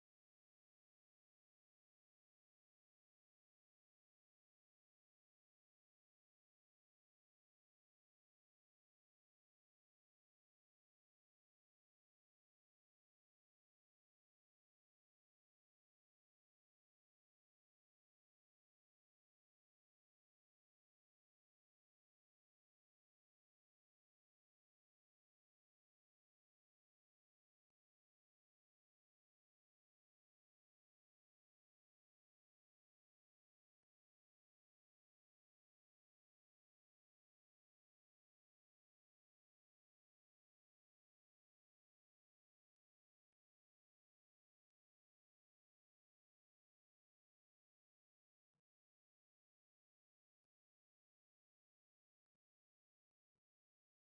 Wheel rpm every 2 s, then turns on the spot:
0, 0, 0, 0, 0, 0, 0, 0, 0, 0, 0, 0, 0, 0, 0, 0, 0, 0, 0, 0, 0, 0, 0, 0, 0, 0, 0.
none